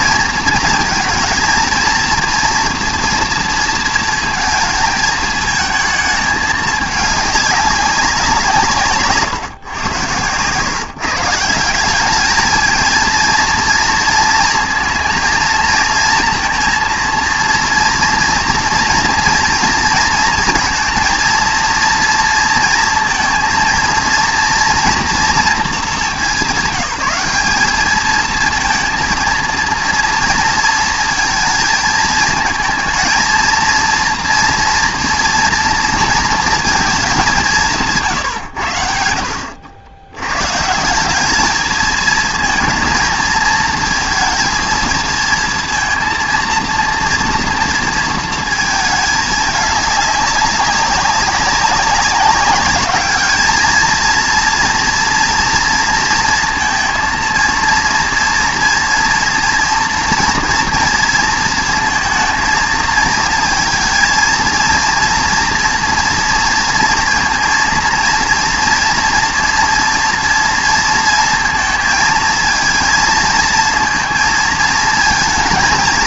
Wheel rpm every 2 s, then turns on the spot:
220, 230, 230, 210, 150, 130, 220, 230, 230, 230, 230, 230, 230, 170, 230, 230, 230, 240, 230, 100, 150, 230, 230, 230, 230, 200, 200, 230, 230, 230, 230, 220, 230, 230, 230, 230, 230, 220.
none